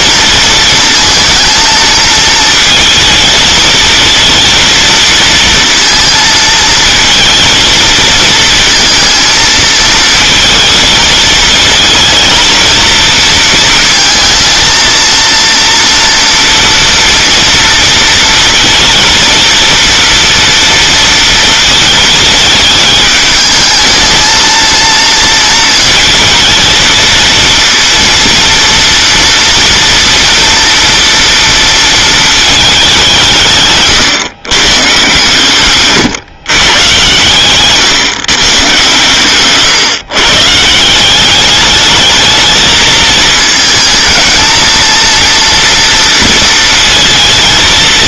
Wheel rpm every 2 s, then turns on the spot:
220, 230, 230, 230, 220, 230, 230, 230, 230, 230, 230, 220, 230, 230, 230, 240, 200, 130, 130, 130, 160, 220, 230, 230.
none